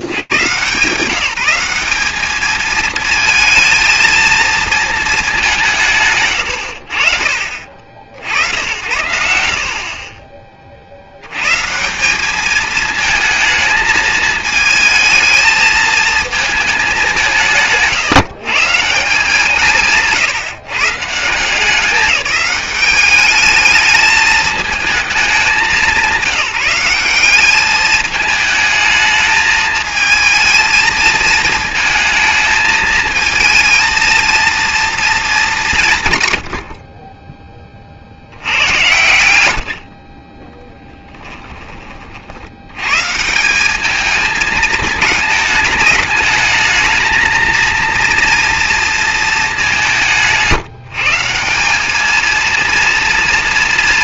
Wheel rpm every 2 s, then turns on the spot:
110, 220, 220, 90, 80, 80, 220, 220, 210, 160, 160, 200, 210, 190, 210, 220, 220, 230, 50, 80, 10, 160, 220, 220, 230, 170, 240.
36-38